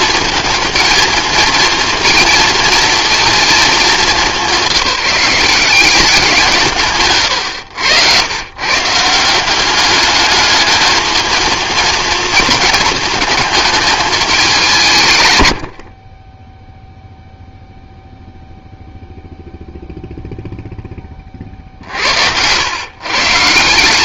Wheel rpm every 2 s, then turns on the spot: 220, 230, 180, 160, 140, 220, 220, 180, 0, 0, 0, 110.
none